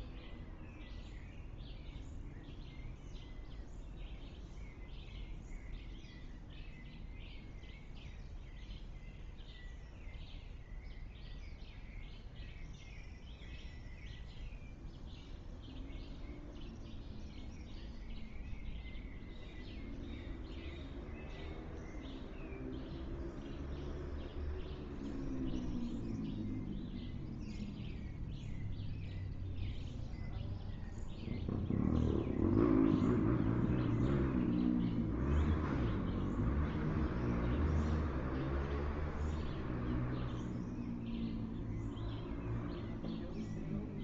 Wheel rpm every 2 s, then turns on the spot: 0, 0, 0, 0, 0, 0, 0, 0, 0, 0, 0, 0, 0, 0, 0, 0, 0, 0, 0, 0, 0, 0.
none